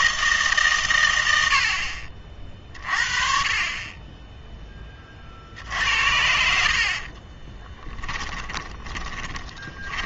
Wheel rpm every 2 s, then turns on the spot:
140, 50, 20, 60, 20.
6-10